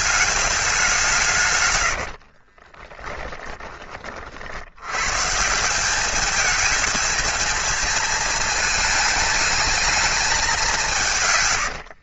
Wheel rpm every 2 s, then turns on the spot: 180, 20, 100, 220, 220, 170.
2-4